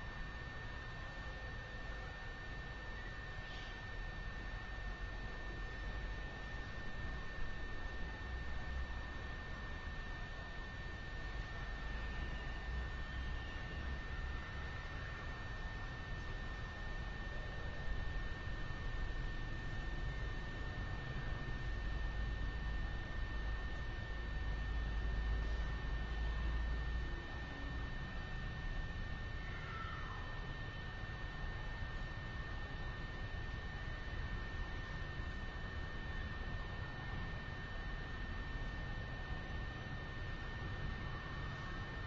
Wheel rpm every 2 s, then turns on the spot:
0, 0, 0, 0, 0, 0, 0, 0, 0, 0, 0, 0, 0, 0, 0, 0, 0, 0, 0, 0, 0.
none